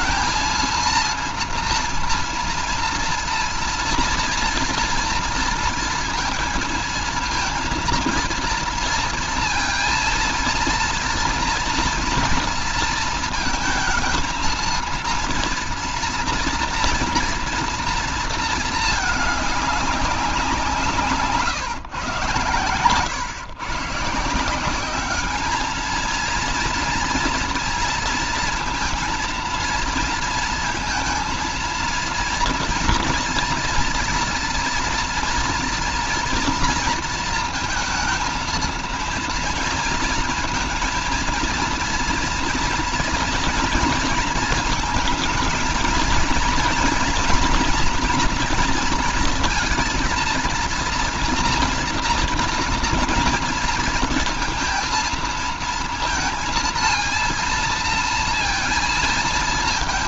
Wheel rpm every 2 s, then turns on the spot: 230, 230, 230, 230, 230, 230, 230, 230, 230, 220, 160, 110, 190, 230, 230, 230, 230, 230, 230, 230, 230, 230, 220, 240, 230, 240, 230, 230, 230, 230.
none